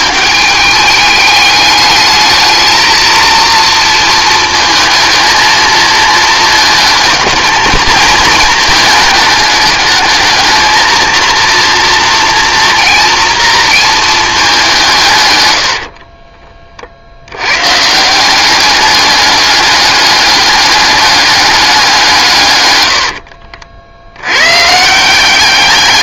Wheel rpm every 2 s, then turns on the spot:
210, 220, 220, 220, 220, 220, 230, 180, 40, 200, 210, 100, 140.
22-24